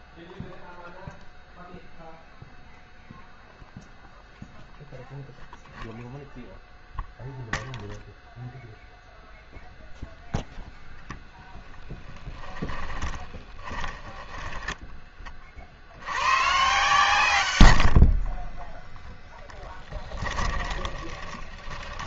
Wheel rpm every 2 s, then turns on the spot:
0, 0, 0, 0, 0, 0, 10, 10, 130, 10, 20.
12-16 18-22